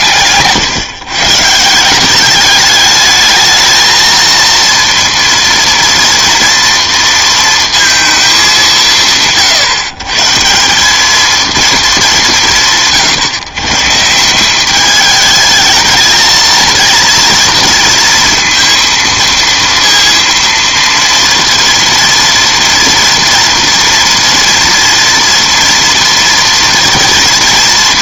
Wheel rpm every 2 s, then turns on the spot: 140, 210, 230, 230, 180, 190, 170, 200, 220, 230, 230, 230, 230, 230.
none